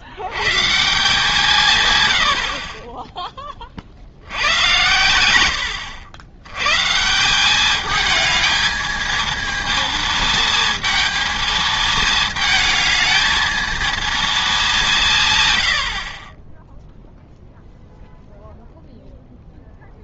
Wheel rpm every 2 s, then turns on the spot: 140, 50, 100, 120, 220, 220, 220, 200, 10, 0.
none